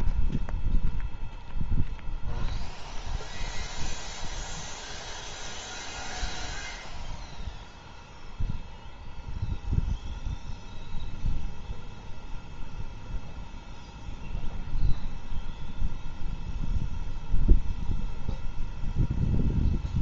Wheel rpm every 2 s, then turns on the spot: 0, 0, 0, 0, 0, 0, 0, 0, 0, 0.
none